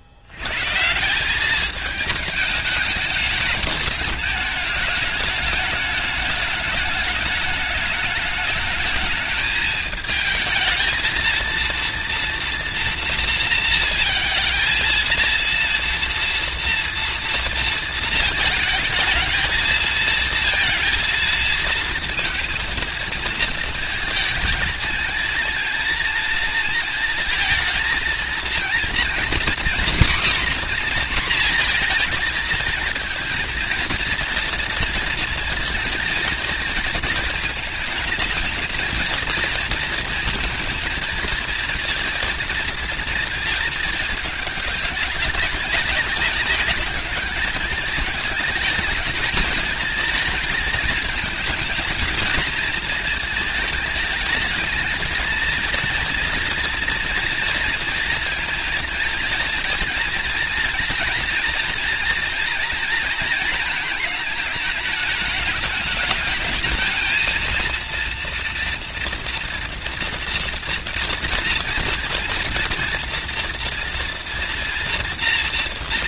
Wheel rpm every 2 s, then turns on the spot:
90, 210, 210, 210, 210, 220, 240, 230, 230, 220, 230, 230, 220, 230, 230, 250, 230, 230, 230, 230, 230, 230, 210, 200, 210, 220, 220, 220, 230, 230, 230, 240, 220, 220, 230, 230, 230, 230.
none